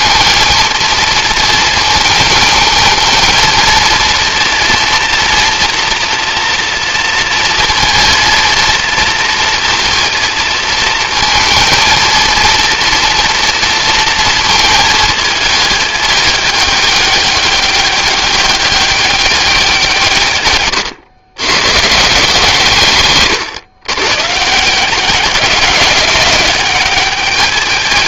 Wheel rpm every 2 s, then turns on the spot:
230, 220, 240, 230, 230, 230, 230, 220, 210, 200, 120, 160, 160, 200.
none